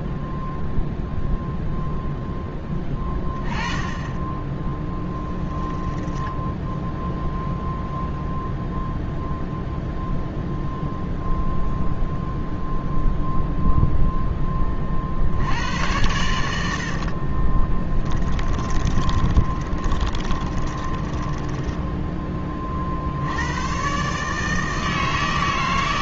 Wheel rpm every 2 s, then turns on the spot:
0, 10, 10, 0, 0, 0, 0, 90, 20, 20, 10, 110, 160.
4-6 16-22